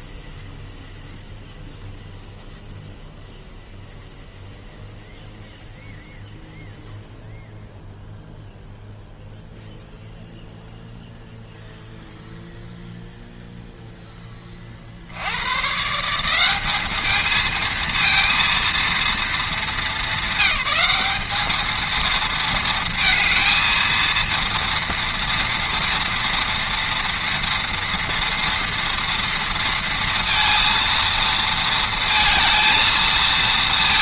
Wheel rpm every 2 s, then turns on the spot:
0, 0, 0, 0, 0, 0, 0, 50, 210, 230, 200, 220, 230, 230, 230, 230, 230.
none